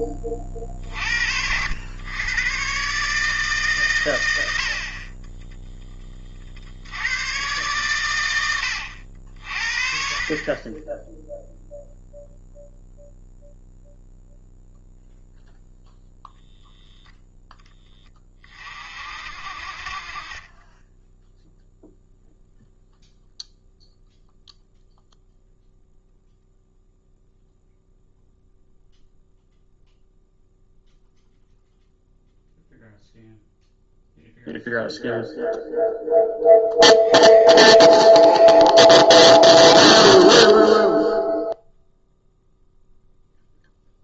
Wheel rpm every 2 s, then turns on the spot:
50, 130, 60, 80, 80, 20, 0, 0, 0, 40, 10, 0, 0, 0, 0, 0, 0, 0, 20, 10, 0, 0.
none